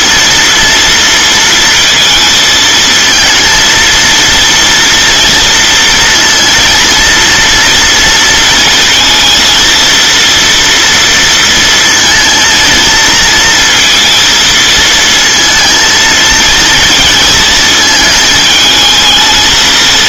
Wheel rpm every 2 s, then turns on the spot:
230, 220, 230, 230, 230, 230, 230, 230, 230, 220.
none